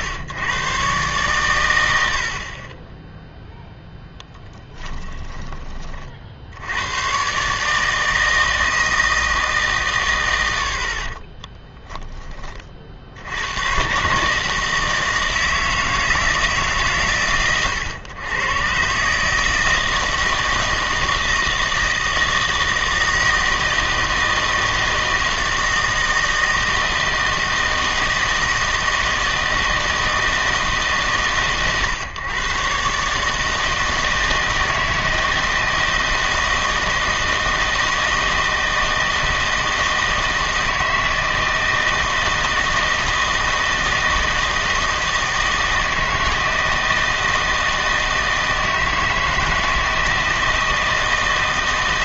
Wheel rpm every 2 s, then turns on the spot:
120, 20, 10, 90, 160, 70, 40, 160, 140, 130, 160, 160, 160, 160, 160, 150, 130, 160, 160, 160, 160, 160, 160, 160, 160, 160.
4-6